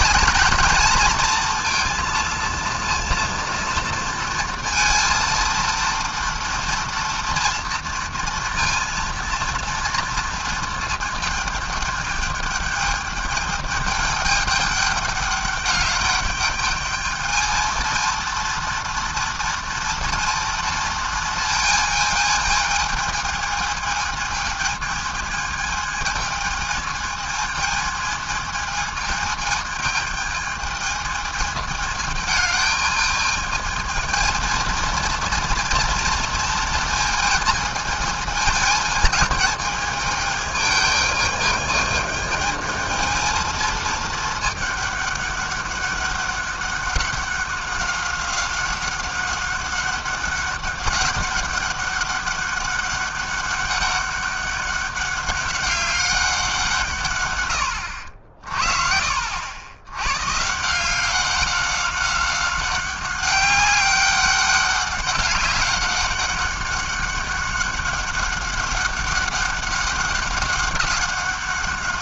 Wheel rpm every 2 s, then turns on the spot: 230, 230, 230, 230, 230, 220, 210, 210, 210, 230, 230, 220, 220, 220, 220, 220, 210, 230, 230, 220, 220, 220, 210, 200, 190, 200, 200, 200, 160, 50, 170, 190, 200, 190, 200, 190.
none